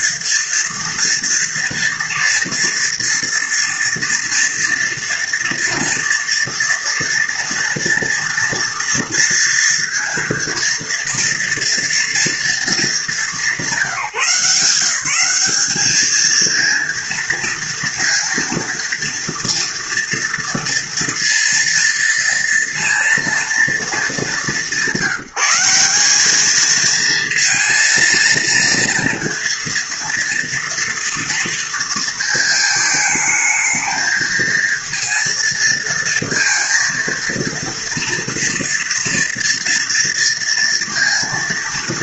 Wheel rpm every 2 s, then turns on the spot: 230, 230, 230, 230, 230, 230, 200, 200, 230, 230, 230, 230, 170, 220, 230, 230, 220, 230, 230, 230, 230.
none